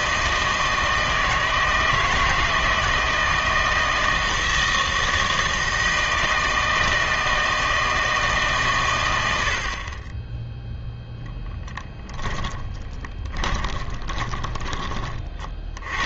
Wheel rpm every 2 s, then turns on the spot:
160, 160, 160, 160, 130, 0, 20, 30.
12-14